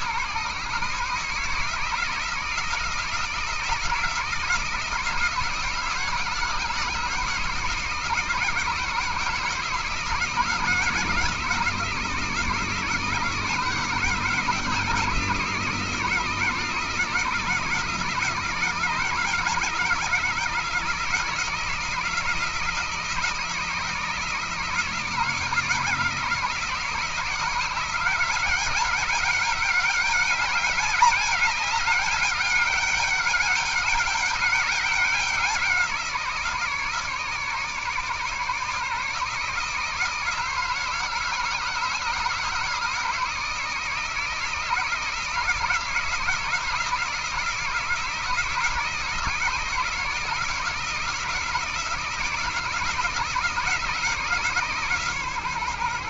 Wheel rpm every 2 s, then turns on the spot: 140, 160, 160, 160, 160, 160, 160, 160, 160, 160, 160, 160, 160, 160, 180, 200, 200, 200, 160, 150, 160, 160, 160, 160, 160, 170, 160, 160.
none